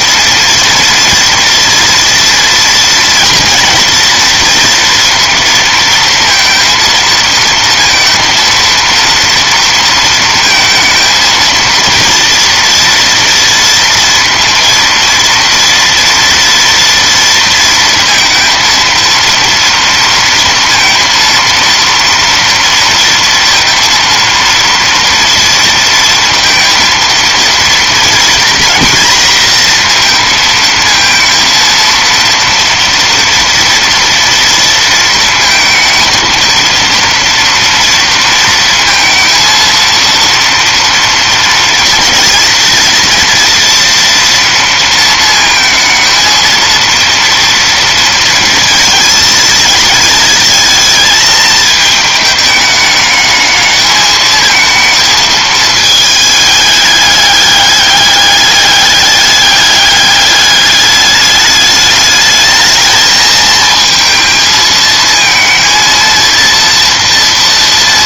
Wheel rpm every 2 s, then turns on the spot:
230, 230, 230, 230, 230, 230, 230, 230, 230, 230, 230, 230, 230, 230, 240, 220, 230, 230, 230, 230, 230, 240, 230, 230, 230, 220, 210, 220, 210, 200, 210, 220, 230, 230.
none